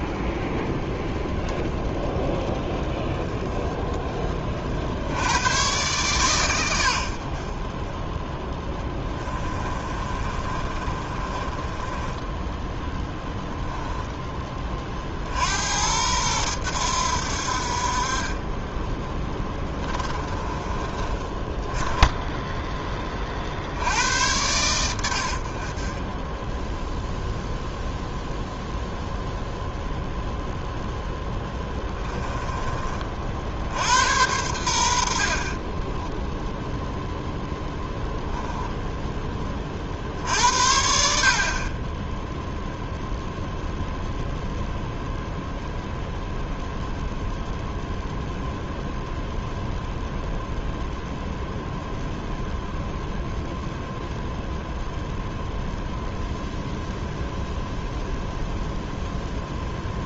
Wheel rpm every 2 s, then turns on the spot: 0, 10, 60, 100, 10, 30, 10, 30, 90, 20, 30, 20, 100, 0, 0, 0, 30, 90, 0, 10, 60, 0, 0, 0, 0, 0, 0, 0, 0, 0.
8-12 20-22